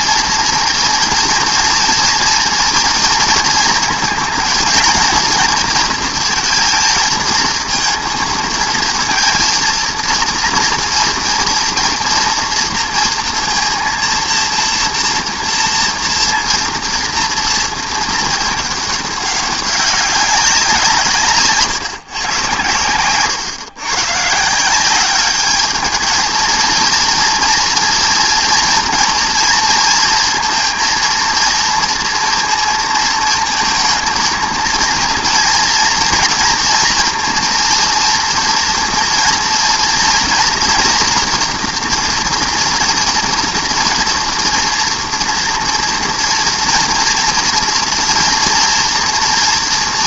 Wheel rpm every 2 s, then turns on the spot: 240, 230, 230, 230, 230, 230, 230, 230, 230, 230, 200, 140, 110, 210, 230, 230, 230, 220, 230, 230, 230, 230, 230, 240, 230.
none